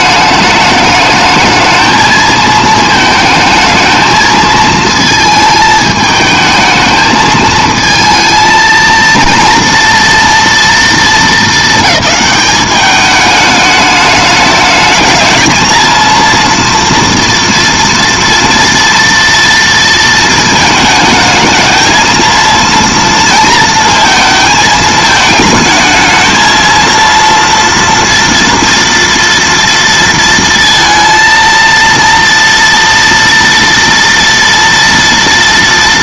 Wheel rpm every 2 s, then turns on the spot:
210, 220, 220, 220, 220, 230, 210, 210, 230, 240, 220, 230, 220, 220, 230, 230, 230, 230.
none